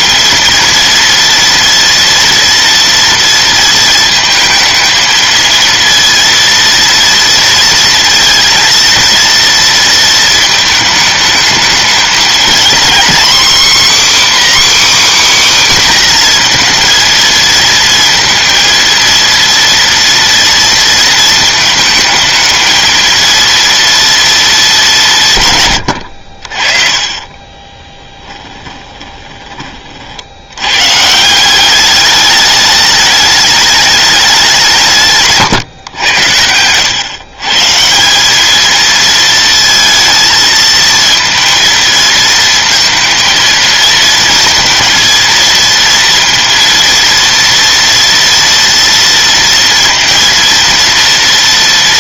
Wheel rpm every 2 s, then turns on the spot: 230, 230, 220, 230, 230, 220, 240, 300, 230, 230, 230, 220, 190, 40, 20, 120, 210, 160, 110, 220, 230, 230, 230, 230, 230, 230.
28-30